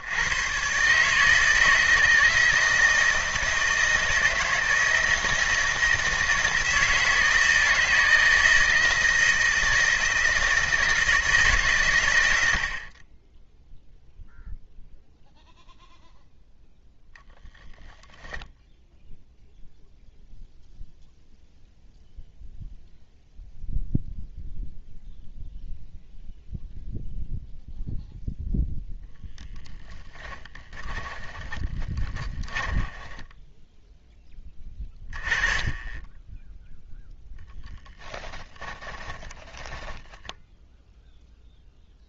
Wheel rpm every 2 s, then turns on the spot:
130, 160, 160, 160, 160, 160, 40, 0, 0, 0, 0, 0, 0, 0, 0, 10, 10, 10, 0, 10, 0.
30-34 38-40